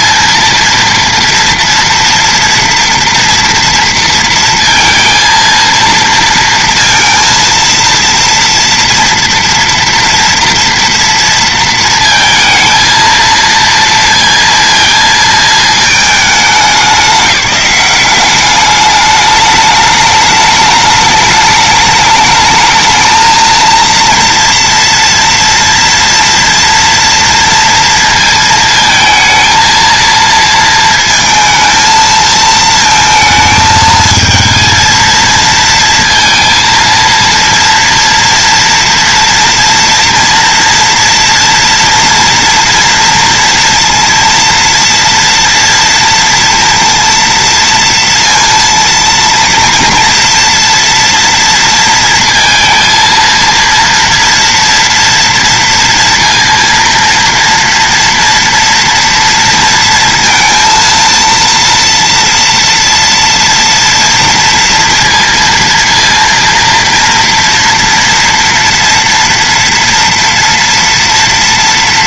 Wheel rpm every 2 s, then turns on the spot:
230, 230, 230, 230, 230, 230, 230, 230, 210, 200, 210, 210, 230, 230, 230, 230, 220, 230, 230, 230, 230, 230, 230, 230, 230, 230, 230, 230, 230, 230, 230, 230, 230, 230, 230, 230.
none